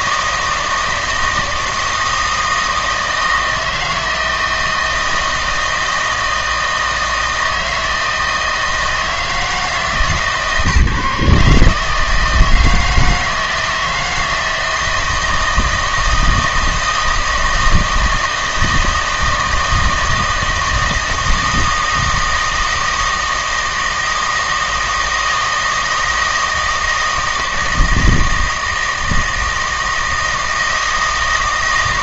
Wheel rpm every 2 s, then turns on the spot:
160, 160, 160, 160, 160, 150, 160, 160, 160, 160, 160, 160, 160, 160, 160, 160.
none